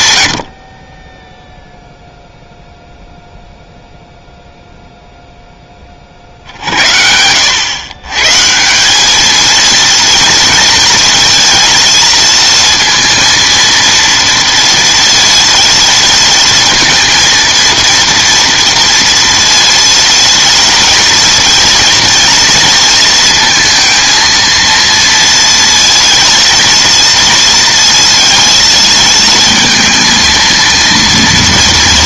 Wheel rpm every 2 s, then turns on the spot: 40, 0, 0, 80, 190, 230, 230, 230, 230, 230, 230, 230, 230, 230, 230, 230.
none